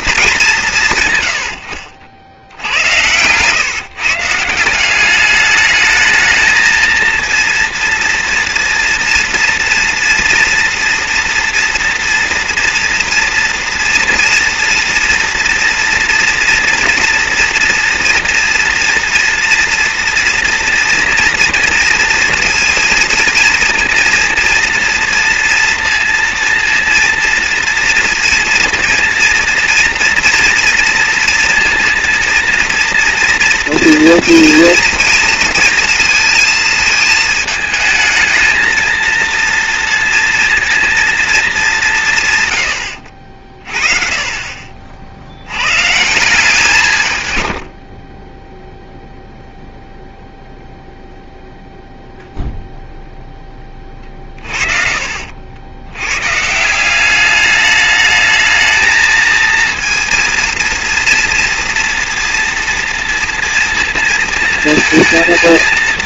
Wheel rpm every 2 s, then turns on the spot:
120, 110, 190, 230, 240, 230, 230, 230, 230, 230, 230, 230, 230, 230, 230, 230, 230, 230, 220, 230, 230, 70, 40, 140, 0, 0, 0, 40, 150, 220, 230, 230, 230.
none